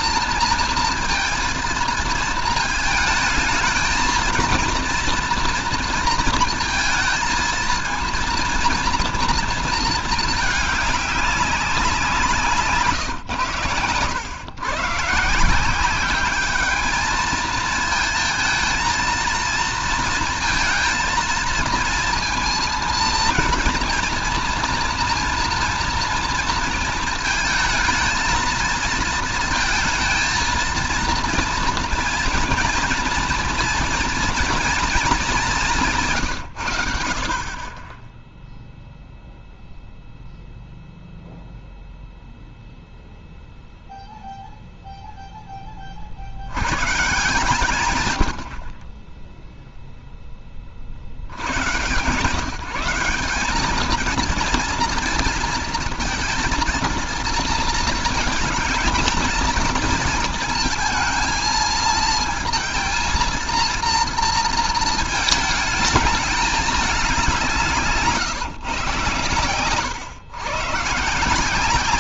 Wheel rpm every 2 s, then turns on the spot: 230, 220, 230, 230, 230, 210, 140, 130, 210, 220, 230, 230, 230, 230, 220, 230, 240, 230, 100, 0, 0, 0, 0, 130, 40, 40, 160, 230, 230, 220, 230, 230, 230, 210, 140, 140.
none